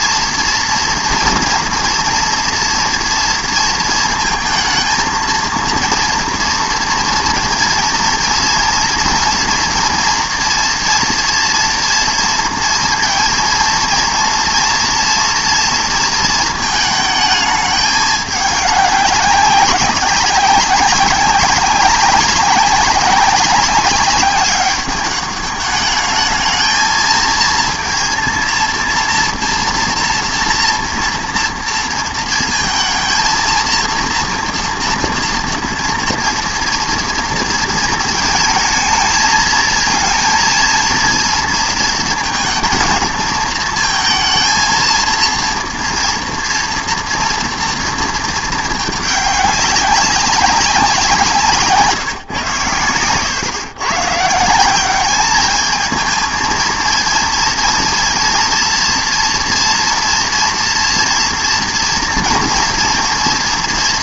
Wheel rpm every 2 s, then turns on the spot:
230, 230, 220, 230, 230, 240, 230, 230, 220, 200, 190, 190, 200, 220, 230, 230, 230, 240, 230, 220, 230, 220, 230, 240, 220, 190, 120, 170, 220, 230, 230, 230.
none